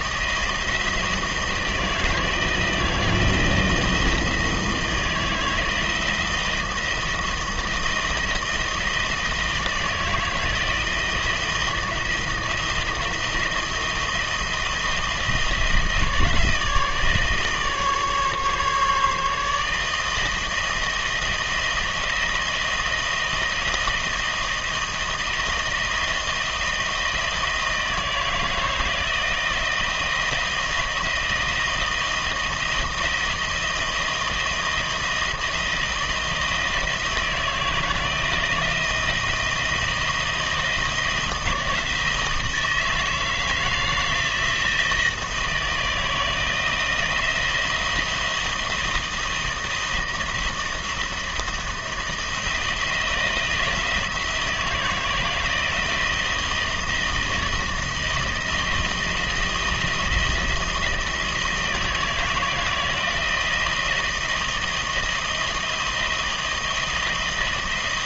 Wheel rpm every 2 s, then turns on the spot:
160, 170, 160, 160, 160, 160, 160, 160, 160, 150, 160, 160, 160, 160, 160, 160, 160, 160, 160, 170, 160, 160, 160, 170, 160, 170, 170, 160, 160, 170, 160, 160, 170, 160.
none